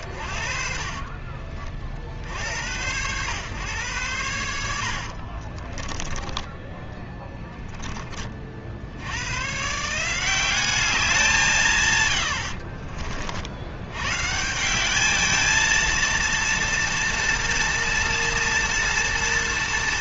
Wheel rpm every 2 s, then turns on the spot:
60, 90, 70, 20, 80, 190, 60, 190, 230, 230.
0-2 4-8 12-14